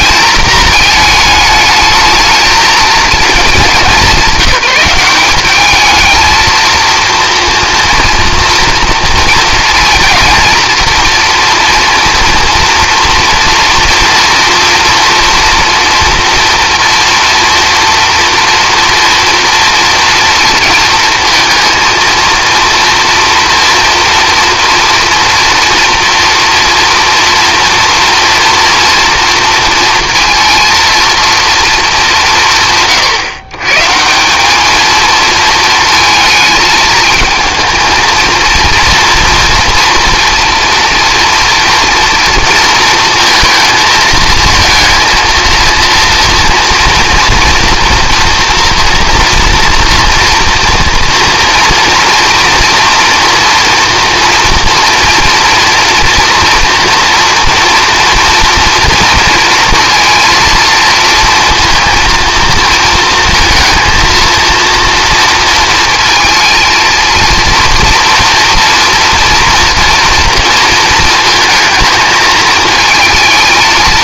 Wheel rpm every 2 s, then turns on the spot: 220, 230, 190, 230, 230, 230, 230, 230, 230, 230, 230, 230, 240, 230, 230, 230, 140, 220, 220, 230, 230, 230, 230, 230, 230, 230, 230, 230, 240, 230, 230, 230, 230, 230, 230, 230, 220.
none